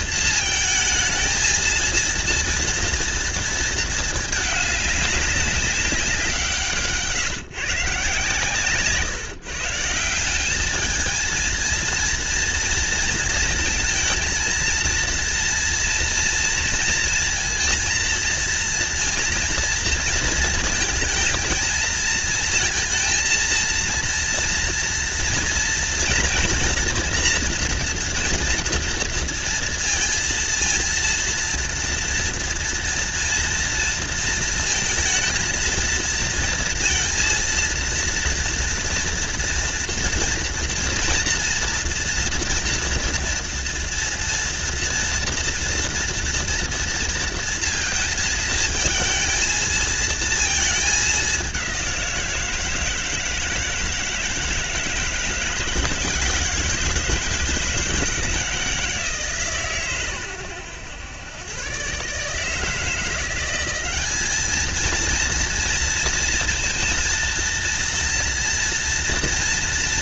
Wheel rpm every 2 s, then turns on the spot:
220, 230, 210, 150, 140, 220, 230, 230, 230, 230, 220, 230, 230, 230, 230, 230, 230, 230, 230, 230, 230, 230, 230, 230, 220, 210, 160, 160, 160, 150, 110, 170, 230, 230, 240.
none